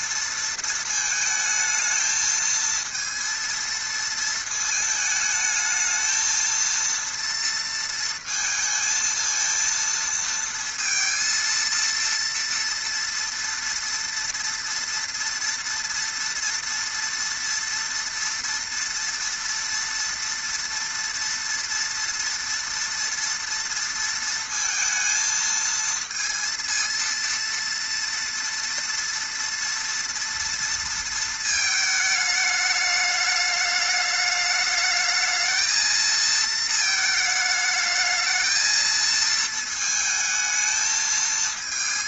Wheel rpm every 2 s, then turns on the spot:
230, 220, 220, 230, 230, 230, 230, 230, 230, 230, 230, 230, 230, 230, 230, 230, 210, 210, 230, 220, 220.
none